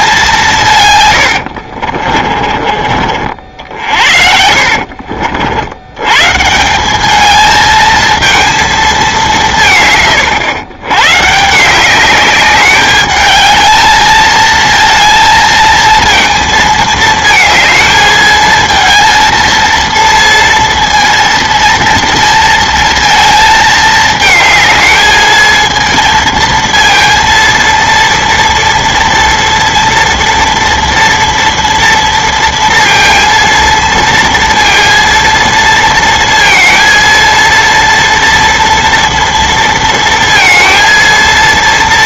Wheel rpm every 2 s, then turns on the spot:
130, 40, 60, 180, 220, 110, 210, 230, 220, 220, 230, 230, 220, 230, 230, 230, 230, 230, 230, 230, 230.
4-6